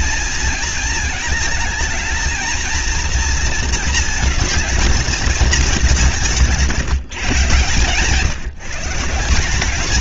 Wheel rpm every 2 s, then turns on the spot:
220, 230, 220, 170, 170.
none